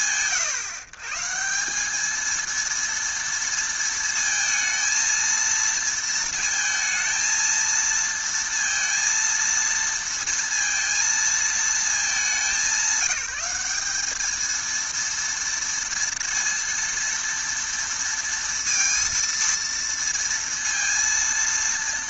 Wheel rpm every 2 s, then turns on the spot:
130, 230, 230, 230, 230, 220, 190, 230, 230, 230, 230.
none